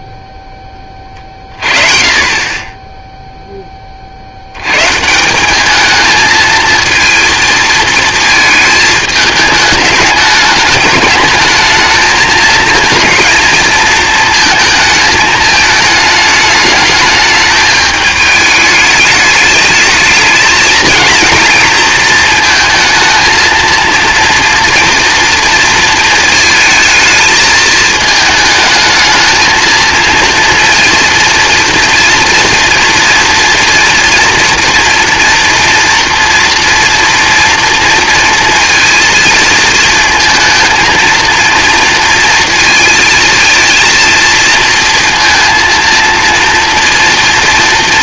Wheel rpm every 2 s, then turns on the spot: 20, 0, 150, 220, 210, 210, 230, 220, 210, 210, 220, 220, 230, 220, 220, 230, 230, 230, 230, 230, 230, 220, 230, 240.
none